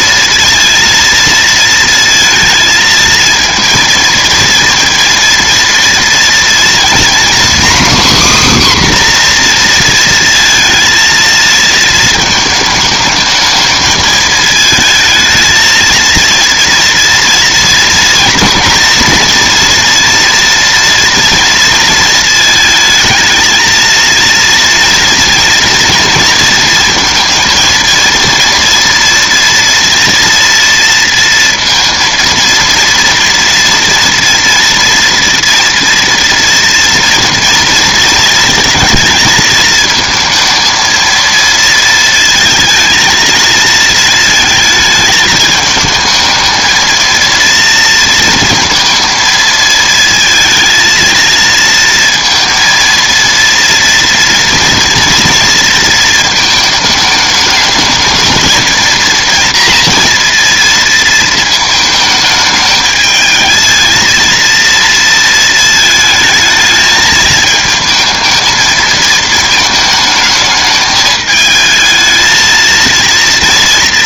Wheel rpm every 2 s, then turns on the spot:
230, 220, 230, 240, 270, 230, 220, 220, 230, 230, 230, 220, 230, 230, 230, 230, 230, 240, 230, 230, 230, 220, 220, 220, 230, 220, 230, 230, 220, 220, 230, 210, 230, 220, 220, 220, 230.
none